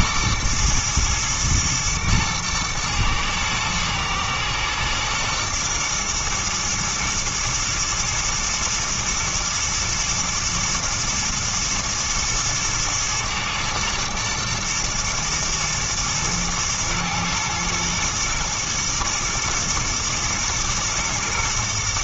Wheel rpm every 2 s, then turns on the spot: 110, 110, 120, 120, 110, 110, 110, 110, 120, 110, 110.
none